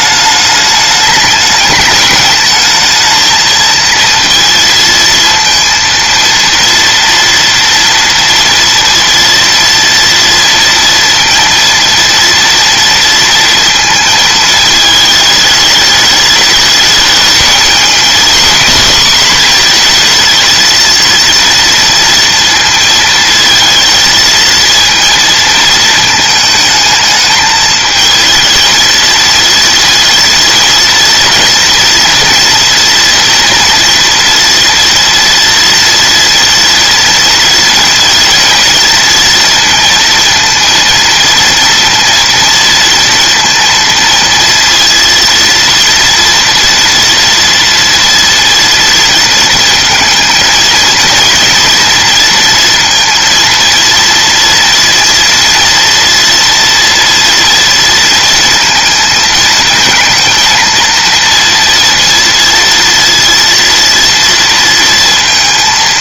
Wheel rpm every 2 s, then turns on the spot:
210, 220, 230, 230, 230, 230, 230, 220, 220, 240, 230, 230, 230, 220, 230, 230, 230, 230, 230, 230, 230, 230, 230, 230, 230, 230, 230, 230, 230, 220, 230, 230, 230.
none